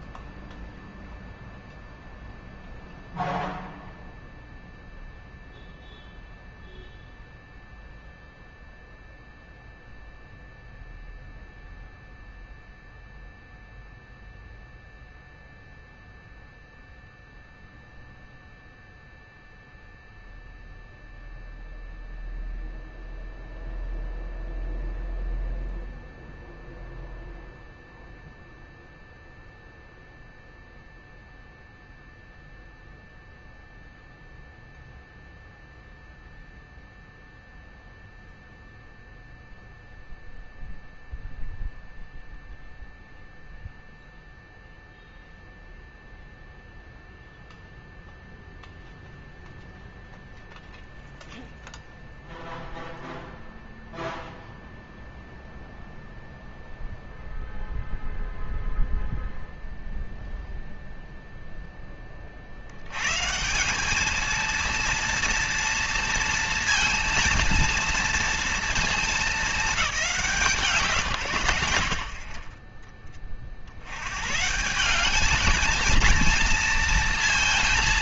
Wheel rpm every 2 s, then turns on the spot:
0, 0, 0, 0, 0, 0, 0, 0, 0, 0, 0, 0, 0, 0, 0, 0, 0, 0, 0, 0, 0, 0, 0, 0, 0, 0, 0, 0, 0, 0, 0, 80, 230, 230, 230, 150, 30, 160, 230.
none